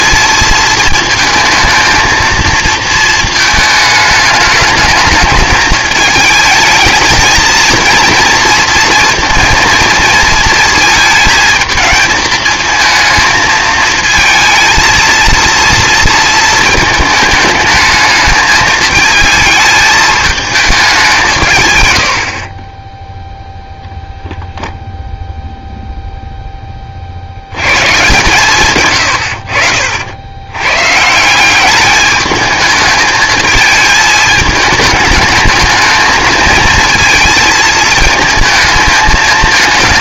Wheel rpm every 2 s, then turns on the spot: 230, 230, 210, 220, 230, 230, 220, 230, 220, 220, 210, 30, 0, 20, 130, 120, 220, 220, 230, 220.
none